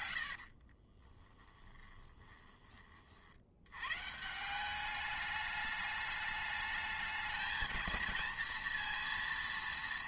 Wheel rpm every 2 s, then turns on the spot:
40, 20, 180, 210, 230.
0-2